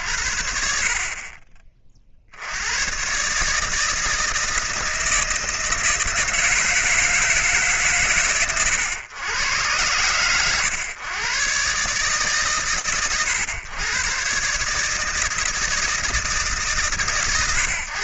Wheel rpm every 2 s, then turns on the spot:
40, 160, 160, 110, 100, 130, 140, 160, 100.
none